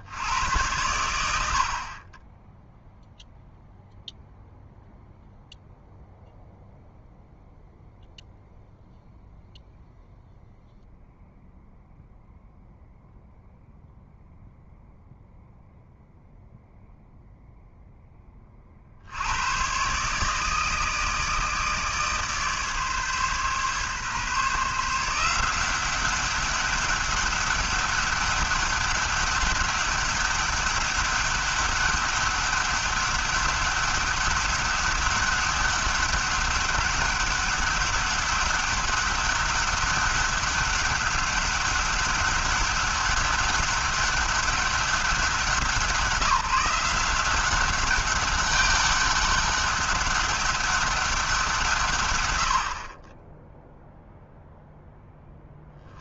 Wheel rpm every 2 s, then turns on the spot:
100, 0, 0, 0, 0, 0, 0, 0, 0, 50, 160, 150, 160, 200, 200, 200, 200, 200, 200, 200, 190, 200, 190, 170, 200, 200, 50, 0.
none